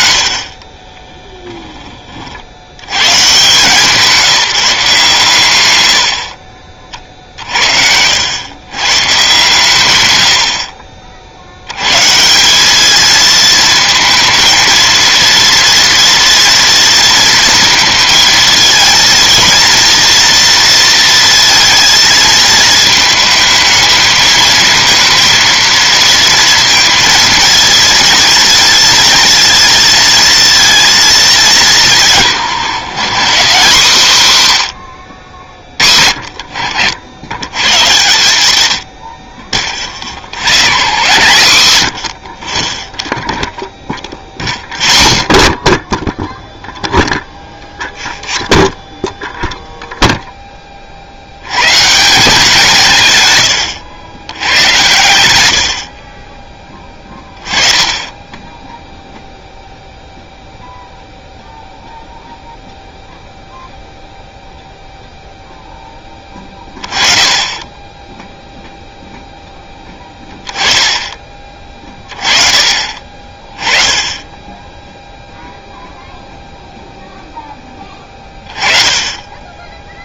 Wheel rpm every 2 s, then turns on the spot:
20, 100, 170, 50, 130, 40, 200, 230, 230, 230, 230, 220, 230, 230, 230, 220, 160, 120, 60, 80, 130, 20, 0, 0, 0, 30, 160, 100, 10, 10, 0, 0, 0, 20, 0, 20, 30, 0, 0, 20.
0-2